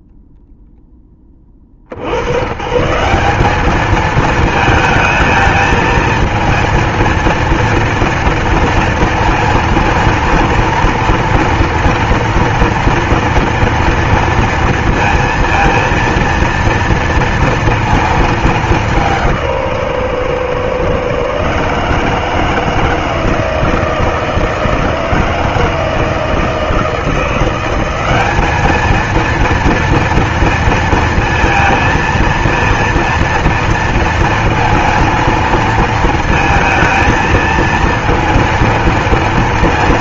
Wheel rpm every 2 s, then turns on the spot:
0, 140, 220, 230, 230, 230, 240, 230, 230, 210, 130, 160, 160, 160, 210, 230, 230, 230, 230, 230.
none